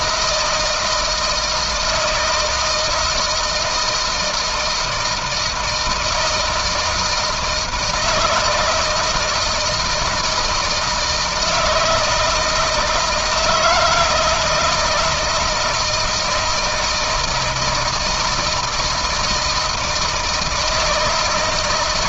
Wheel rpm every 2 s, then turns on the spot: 160, 160, 170, 160, 160, 160, 160, 160, 160, 160, 160.
none